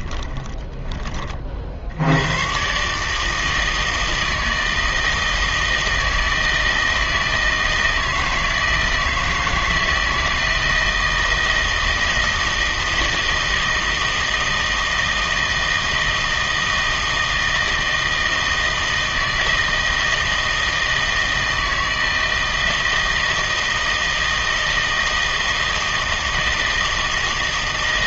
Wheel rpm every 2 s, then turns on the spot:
10, 120, 160, 160, 160, 160, 160, 160, 160, 160, 160, 160, 160, 160.
none